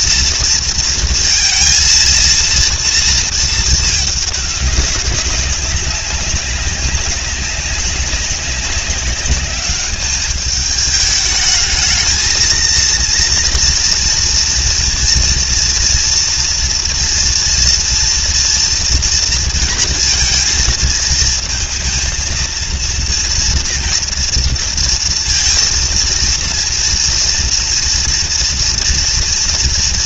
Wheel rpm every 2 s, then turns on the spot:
230, 230, 200, 190, 200, 210, 230, 230, 230, 230, 220, 230, 230, 230, 230.
none